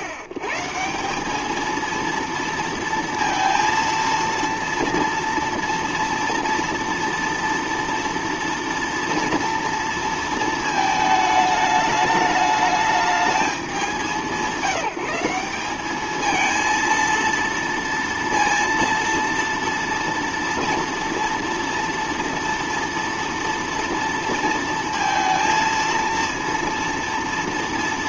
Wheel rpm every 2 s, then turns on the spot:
120, 230, 230, 230, 240, 220, 210, 180, 230, 230, 230, 230, 230, 230.
none